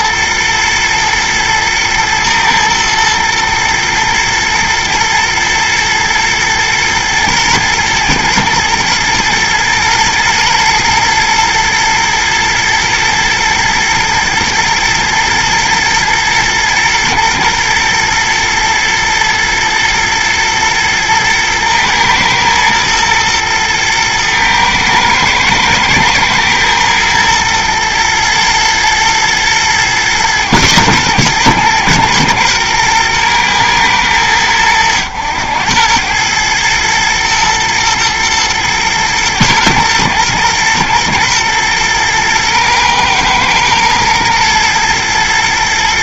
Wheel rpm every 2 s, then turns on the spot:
120, 110, 110, 110, 120, 110, 110, 120, 110, 120, 120, 120, 110, 110, 110, 110, 120, 100, 110, 120, 110, 110, 110.
none